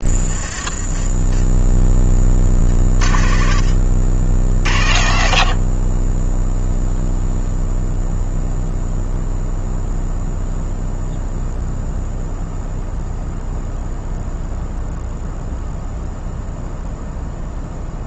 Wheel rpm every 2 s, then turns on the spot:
10, 40, 70, 0, 0, 0, 0, 0, 0.
none